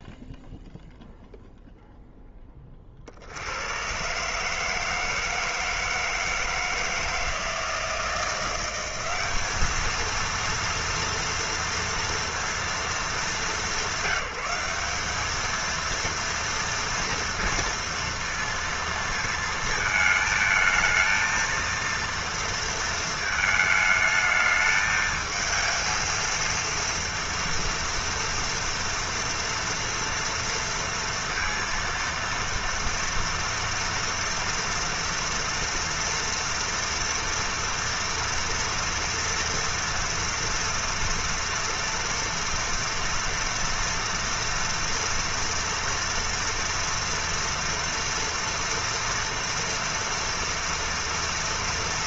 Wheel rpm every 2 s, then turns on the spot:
0, 20, 150, 160, 180, 230, 230, 190, 230, 230, 220, 230, 220, 230, 230, 230, 230, 240, 240, 240, 230, 230, 230, 230, 230, 230.
none